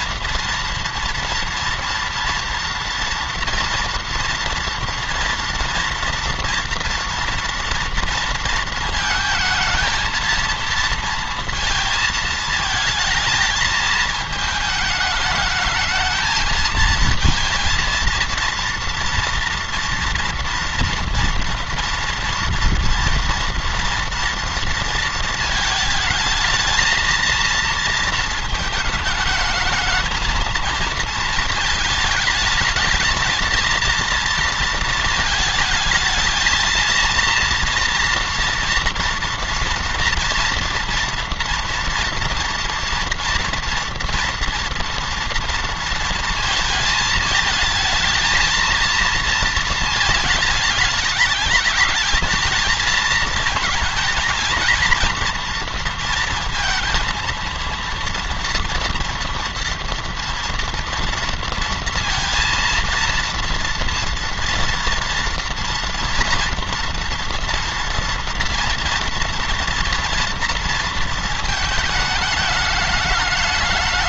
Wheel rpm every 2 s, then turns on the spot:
230, 230, 240, 240, 230, 230, 220, 210, 220, 230, 230, 230, 230, 230, 220, 220, 220, 230, 230, 230, 230, 230, 230, 220, 220, 210, 220, 230, 230, 230, 240, 230, 230, 230, 230, 230, 210.
none